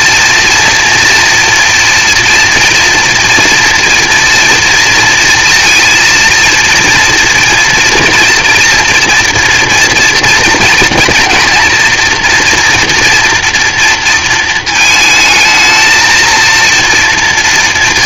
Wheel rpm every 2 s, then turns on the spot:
230, 230, 230, 230, 230, 230, 230, 220, 230.
none